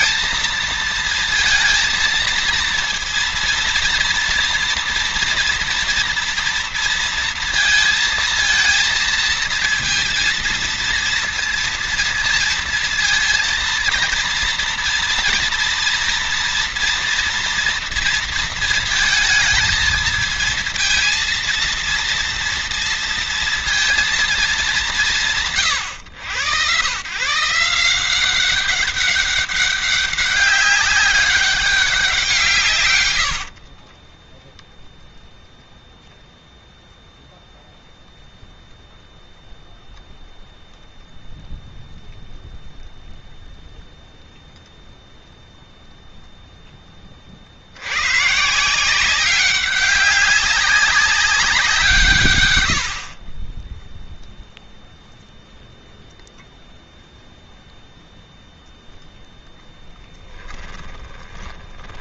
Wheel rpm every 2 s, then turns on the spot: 230, 230, 230, 230, 220, 230, 230, 230, 230, 220, 230, 230, 170, 120, 190, 200, 140, 0, 0, 0, 0, 0, 0, 20, 160, 190, 70, 0, 0, 0, 10.
60-62